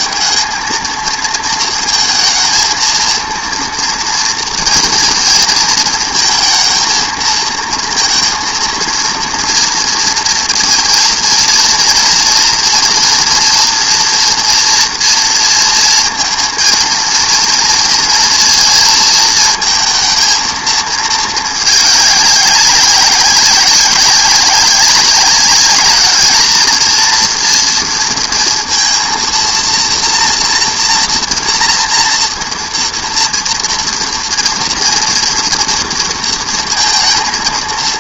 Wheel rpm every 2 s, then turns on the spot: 220, 230, 230, 230, 230, 230, 230, 230, 230, 230, 220, 200, 190, 220, 230, 240, 230, 230, 230.
none